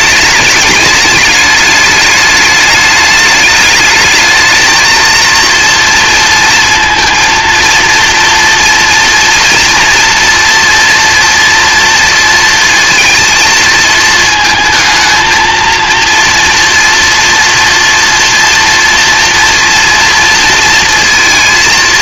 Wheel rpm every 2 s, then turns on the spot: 210, 210, 220, 230, 230, 230, 230, 220, 230, 230, 230.
none